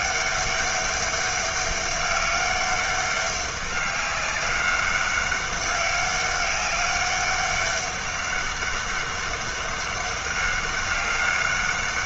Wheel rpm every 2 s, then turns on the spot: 200, 200, 200, 200, 200, 200.
none